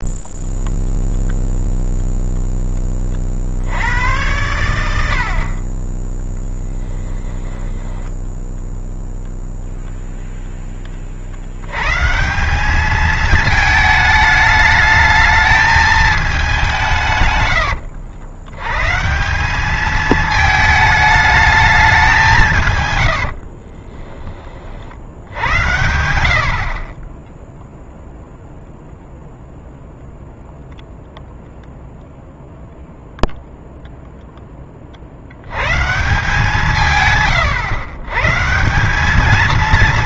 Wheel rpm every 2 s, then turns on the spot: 0, 10, 90, 10, 0, 10, 200, 210, 200, 120, 220, 130, 40, 50, 0, 0, 0, 60, 130, 190.
6-8